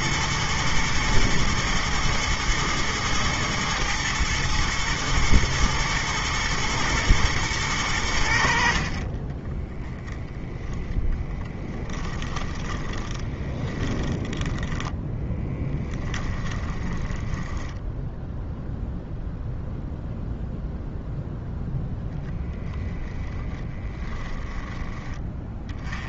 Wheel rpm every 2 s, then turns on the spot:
110, 110, 110, 110, 40, 10, 10, 0, 10, 0, 0, 10, 10.
10-14 16-18